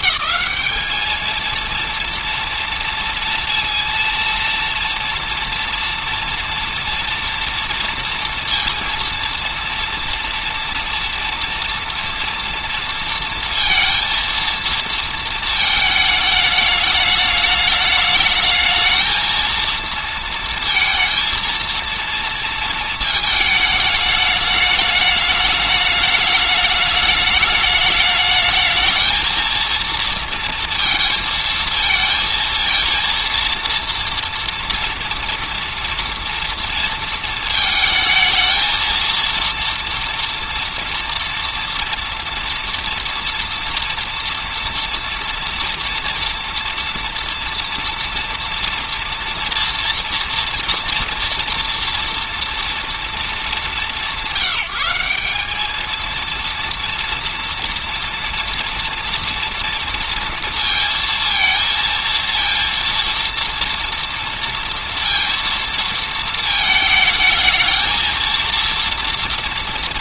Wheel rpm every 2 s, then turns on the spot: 210, 230, 230, 230, 230, 230, 230, 230, 210, 220, 230, 220, 210, 210, 220, 230, 230, 230, 230, 230, 230, 230, 230, 230, 230, 230, 230, 180, 230, 230, 230, 230, 230, 220, 230.
none